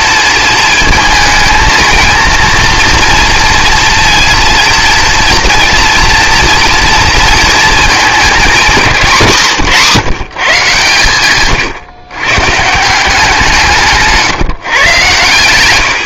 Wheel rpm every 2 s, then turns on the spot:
220, 230, 230, 230, 210, 140, 150, 140.
none